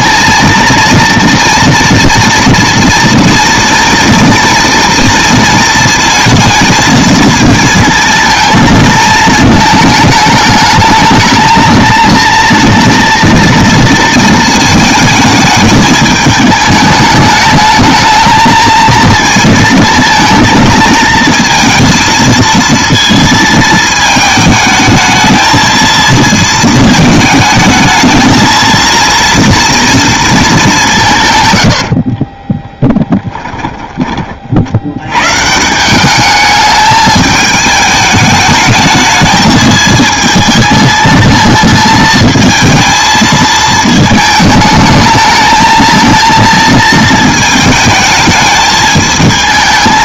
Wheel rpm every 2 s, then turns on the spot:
230, 230, 230, 220, 220, 210, 230, 220, 210, 220, 220, 230, 220, 220, 230, 190, 10, 70, 210, 220, 220, 220, 210, 230, 210.
32-34